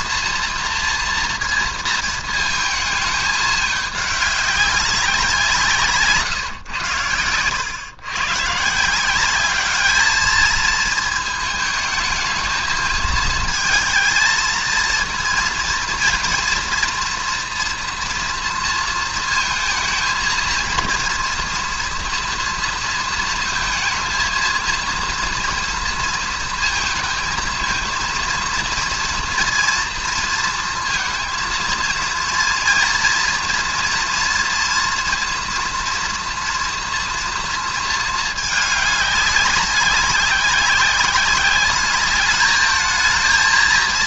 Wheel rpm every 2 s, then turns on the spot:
230, 220, 200, 130, 140, 220, 220, 230, 230, 230, 230, 230, 230, 220, 230, 230, 230, 230, 230, 210, 190, 210.
none